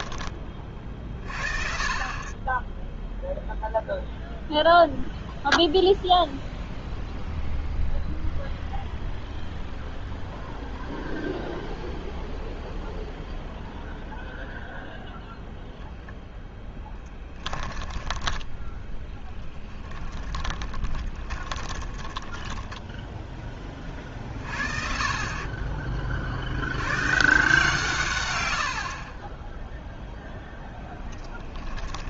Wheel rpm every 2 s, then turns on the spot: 40, 10, 0, 0, 0, 0, 0, 0, 10, 10, 20, 0, 40, 110, 60, 10.
16-22 30-32